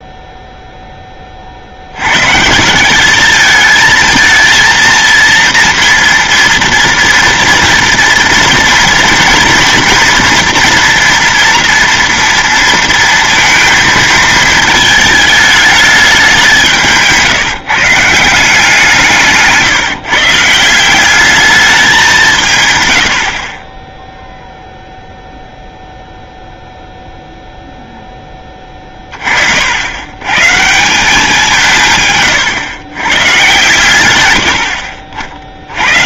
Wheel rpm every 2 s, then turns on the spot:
0, 170, 230, 230, 230, 230, 230, 220, 160, 170, 180, 110, 0, 0, 20, 170, 120, 70.
none